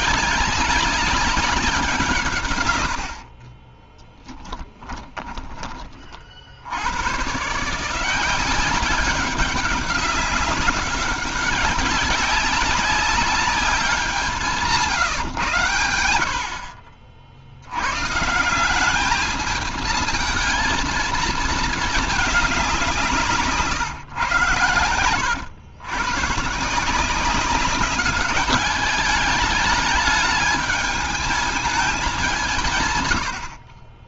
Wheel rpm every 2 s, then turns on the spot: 200, 130, 30, 60, 180, 190, 200, 180, 70, 160, 220, 190, 120, 140, 200, 210, 170.
4-6